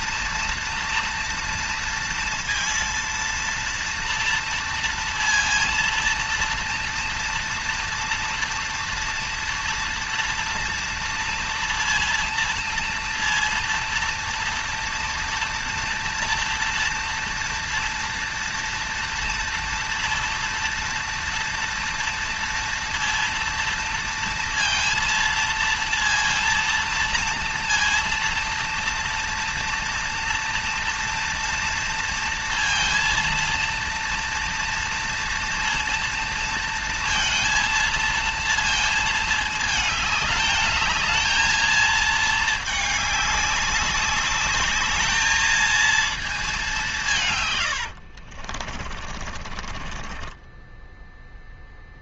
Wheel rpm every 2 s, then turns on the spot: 230, 230, 230, 230, 230, 230, 230, 230, 230, 230, 230, 230, 230, 230, 230, 230, 230, 230, 230, 230, 210, 220, 200, 210, 60, 20.
48-52